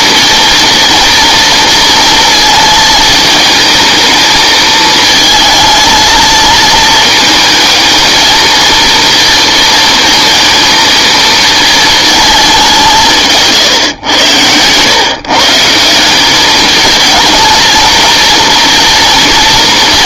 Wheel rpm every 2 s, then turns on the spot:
230, 230, 220, 230, 230, 230, 200, 110, 210, 230.
none